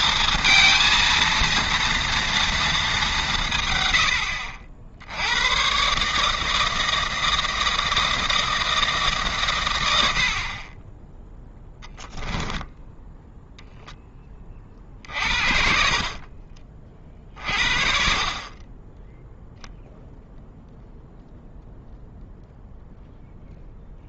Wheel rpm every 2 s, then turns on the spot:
230, 220, 70, 160, 160, 20, 10, 40, 40, 20, 0, 0.
12-14